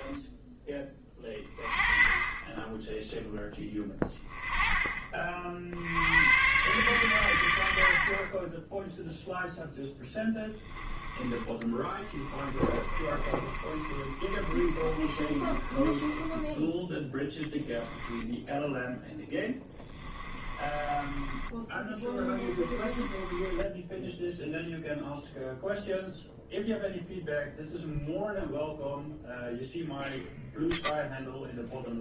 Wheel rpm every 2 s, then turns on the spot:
20, 10, 20, 120, 10, 10, 30, 30, 10, 10, 20, 20, 0, 0, 0, 0.
12-16 20-24